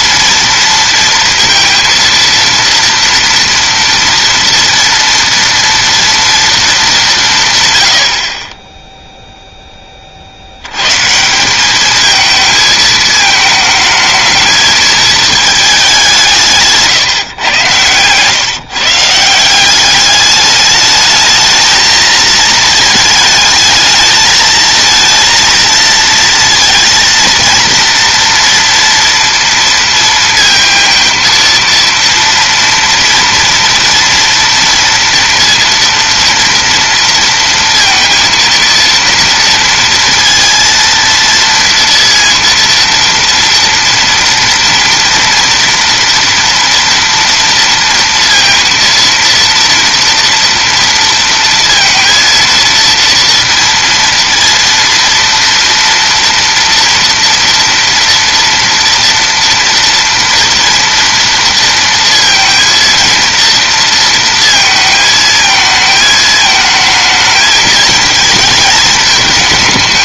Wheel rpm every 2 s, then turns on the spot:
230, 230, 230, 220, 20, 90, 220, 220, 150, 140, 210, 220, 230, 230, 230, 230, 230, 230, 230, 230, 230, 230, 230, 240, 230, 230, 230, 230, 230, 230, 230, 230, 230, 220, 220.
none